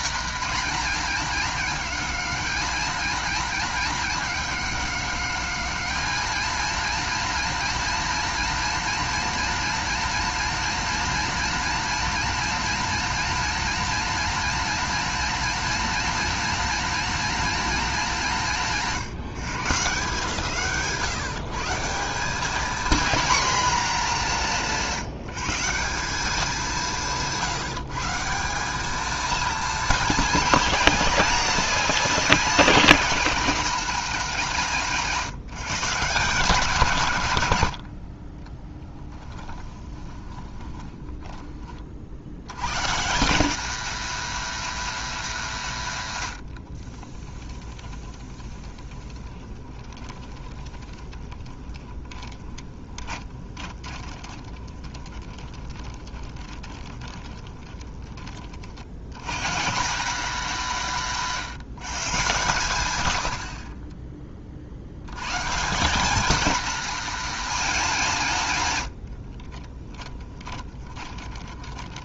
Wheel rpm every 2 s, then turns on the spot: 240, 210, 210, 230, 230, 230, 230, 230, 230, 180, 140, 230, 190, 190, 200, 220, 230, 180, 150, 10, 10, 130, 220, 40, 20, 20, 20, 20, 20, 70, 180, 110, 80, 230, 100, 30.
38-42 46-58 68-72